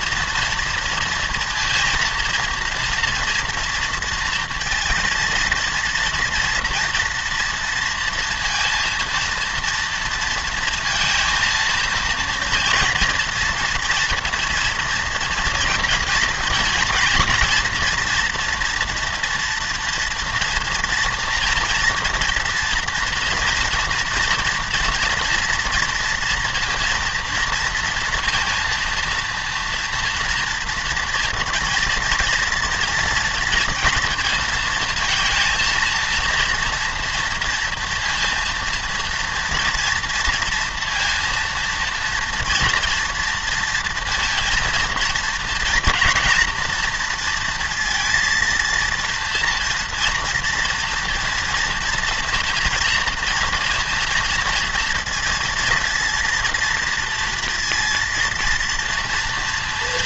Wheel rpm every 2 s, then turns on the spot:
240, 230, 230, 230, 230, 230, 230, 230, 230, 240, 230, 230, 230, 230, 230, 230, 230, 230, 230, 230, 230, 230, 230, 240, 230, 240, 240, 230, 230, 230.
none